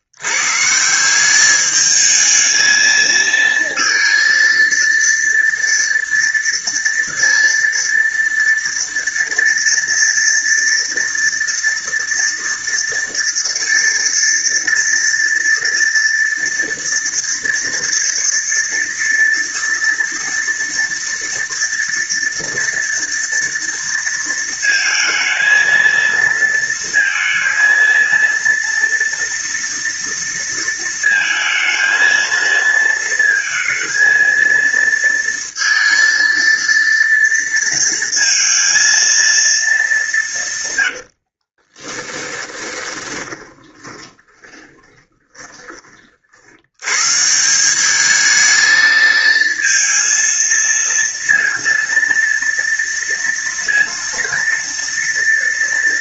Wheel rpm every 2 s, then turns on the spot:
100, 220, 230, 230, 230, 230, 230, 230, 230, 230, 230, 230, 230, 230, 230, 230, 230, 230, 230, 230, 160, 10, 20, 60, 210, 230, 230, 230.
42-46